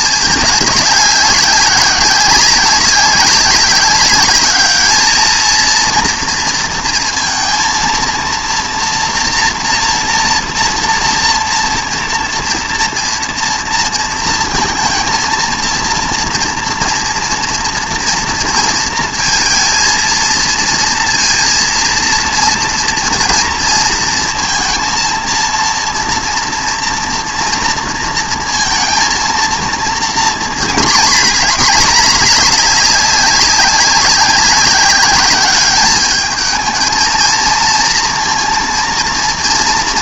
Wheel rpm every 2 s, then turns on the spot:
200, 190, 220, 230, 240, 230, 230, 230, 230, 230, 230, 230, 230, 230, 230, 230, 200, 200, 220, 230.
none